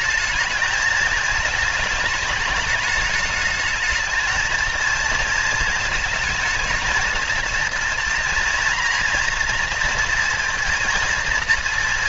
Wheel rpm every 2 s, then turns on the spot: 220, 220, 220, 230, 240, 230.
none